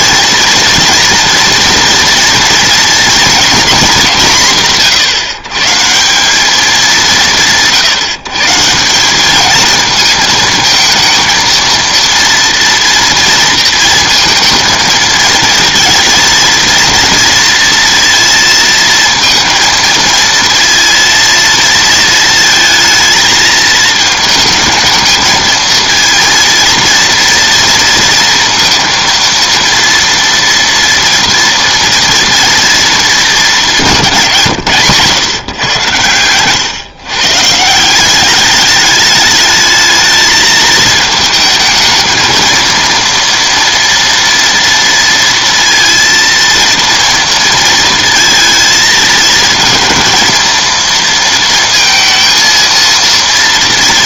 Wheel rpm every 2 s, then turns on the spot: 240, 240, 170, 200, 160, 220, 230, 230, 230, 230, 230, 220, 210, 230, 230, 230, 230, 150, 120, 200, 220, 230, 230, 230, 220, 220, 230.
none